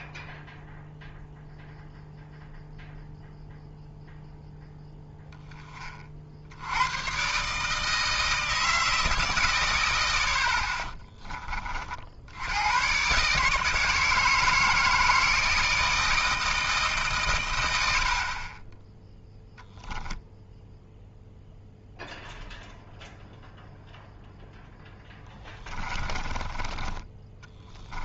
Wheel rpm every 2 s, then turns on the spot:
0, 0, 0, 90, 120, 10, 100, 160, 160, 20, 0, 0, 0, 20.
26-28